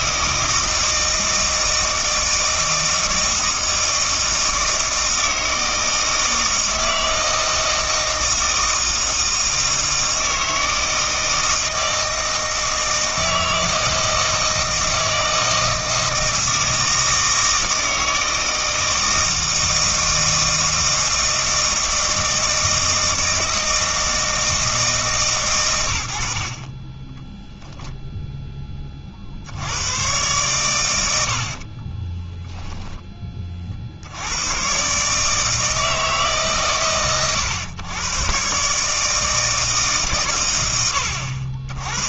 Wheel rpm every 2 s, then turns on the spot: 160, 160, 160, 160, 160, 160, 160, 160, 160, 160, 160, 160, 160, 30, 20, 110, 10, 130, 130, 150, 100.
none